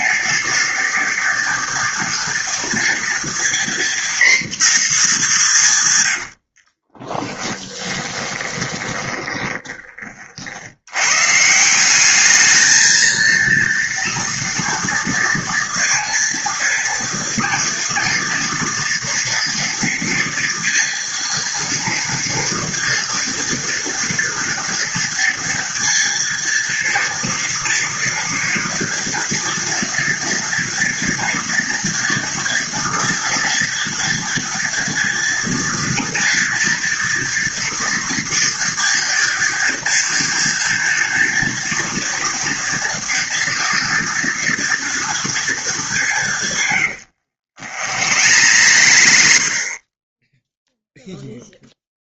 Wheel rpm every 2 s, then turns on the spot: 230, 230, 220, 30, 20, 110, 220, 230, 230, 230, 230, 230, 230, 230, 230, 230, 240, 230, 230, 230, 230, 230, 230, 100, 80, 0.
6-10 46-50